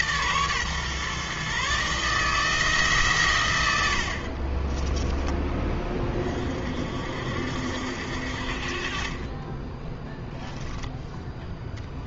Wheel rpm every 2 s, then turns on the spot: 130, 160, 30, 50, 50, 0.
4-6